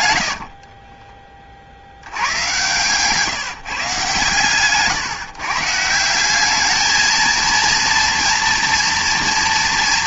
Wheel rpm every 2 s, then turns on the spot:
20, 130, 140, 220, 230.
0-2